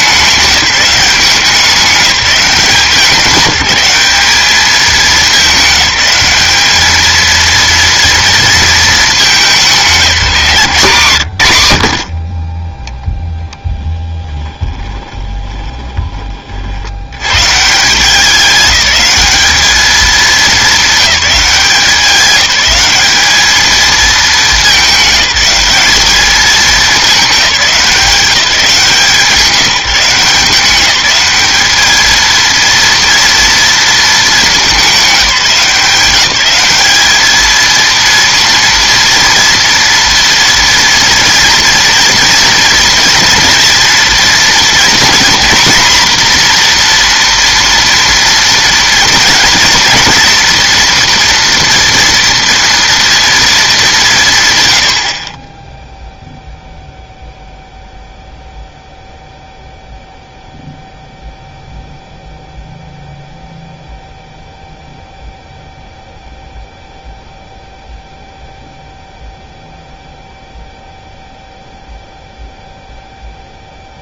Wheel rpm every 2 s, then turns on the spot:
200, 190, 210, 210, 220, 170, 30, 20, 60, 200, 210, 200, 210, 210, 160, 190, 230, 200, 210, 230, 240, 240, 240, 240, 230, 240, 230, 90, 0, 0, 0, 0, 0, 0, 0, 0, 0.
14-16